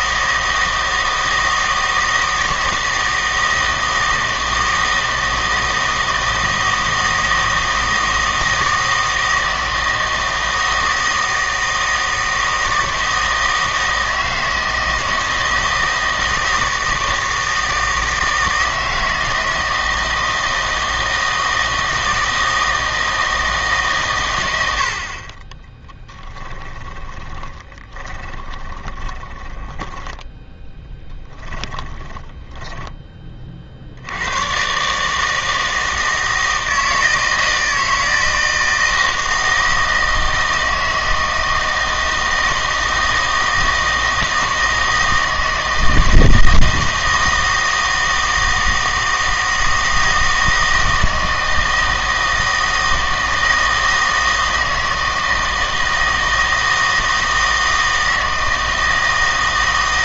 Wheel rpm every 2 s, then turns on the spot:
160, 160, 160, 160, 160, 160, 160, 160, 160, 160, 160, 160, 80, 10, 20, 10, 10, 130, 160, 160, 160, 160, 160, 160, 160, 160, 160, 160, 160, 160.
26-30 32-34